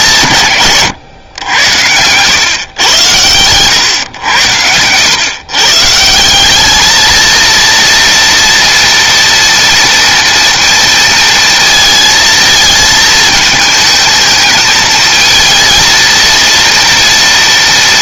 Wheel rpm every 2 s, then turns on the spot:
170, 120, 110, 180, 230, 230, 220, 220, 230.
none